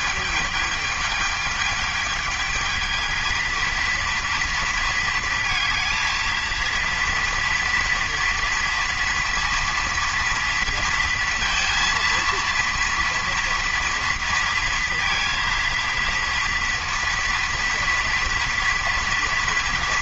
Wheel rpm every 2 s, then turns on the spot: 220, 220, 230, 230, 230, 230, 230, 230, 230, 230.
none